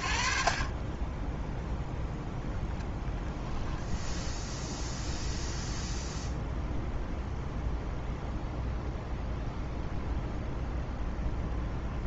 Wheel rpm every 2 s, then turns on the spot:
50, 0, 0, 0, 0, 0.
0-2